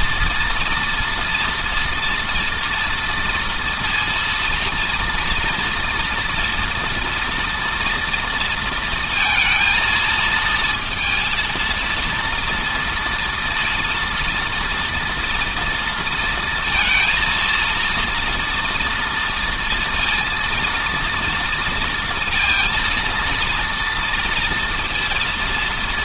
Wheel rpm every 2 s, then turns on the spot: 230, 230, 230, 240, 230, 220, 230, 230, 230, 230, 230, 230, 230.
none